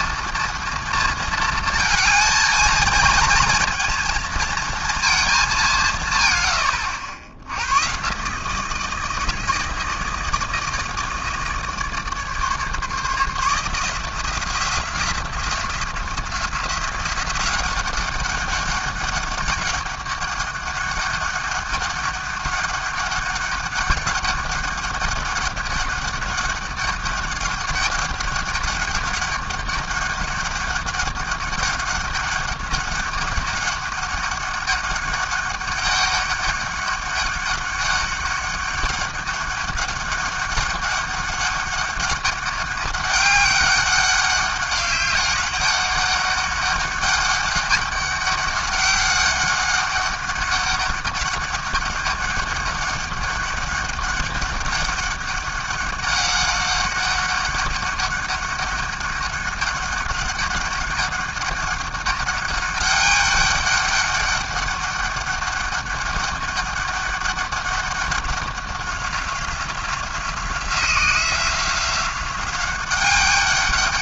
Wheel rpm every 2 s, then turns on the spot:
230, 230, 230, 90, 160, 160, 150, 180, 180, 200, 200, 200, 200, 200, 200, 200, 200, 200, 200, 200, 200, 200, 200, 200, 200, 200, 200, 200, 200, 200, 200, 200, 200, 200, 190, 180, 190.
none